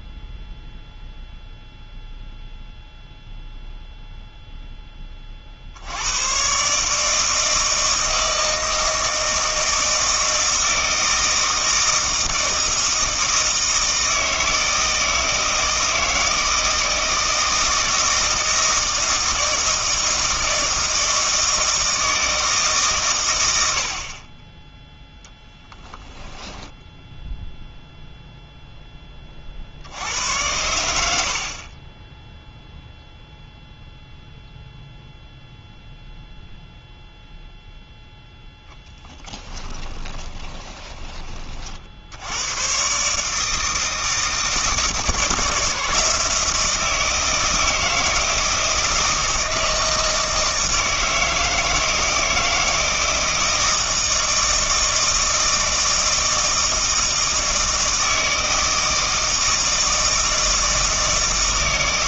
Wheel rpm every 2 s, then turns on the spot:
0, 0, 10, 140, 160, 160, 160, 160, 160, 160, 160, 140, 10, 0, 10, 90, 0, 0, 0, 10, 20, 130, 160, 160, 160, 160, 160, 160, 160, 160, 160.
38-42